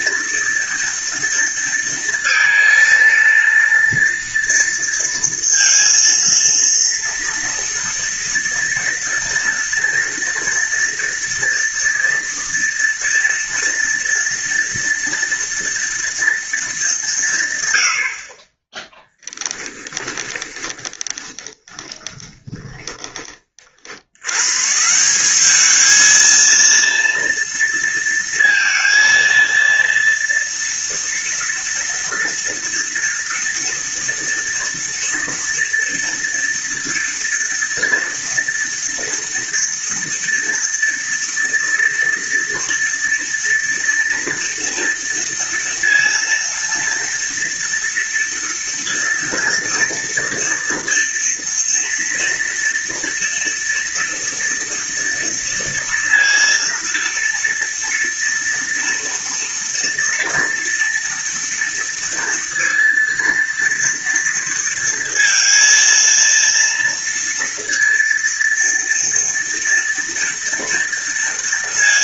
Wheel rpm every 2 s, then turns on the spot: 230, 230, 230, 230, 230, 230, 230, 230, 210, 30, 30, 20, 160, 230, 230, 230, 230, 230, 230, 230, 230, 230, 230, 230, 230, 230, 230, 230, 230, 230, 240, 230, 230, 230, 230, 230.
18-24